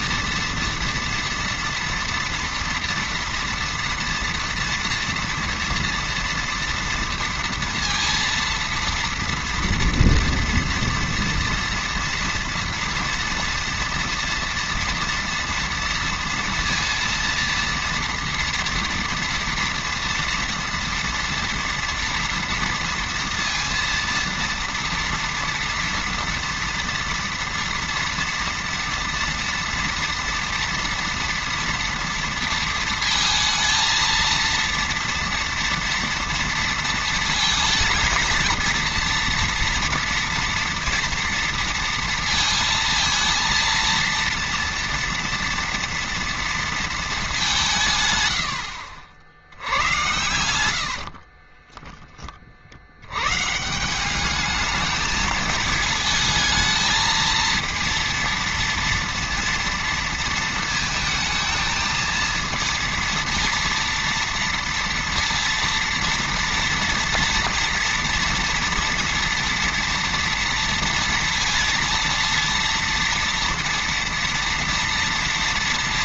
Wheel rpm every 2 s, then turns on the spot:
230, 230, 230, 230, 230, 230, 230, 230, 230, 230, 230, 230, 230, 230, 230, 230, 230, 230, 230, 230, 230, 230, 230, 230, 90, 80, 50, 210, 220, 230, 230, 230, 230, 230, 230, 230, 230, 230.
48-52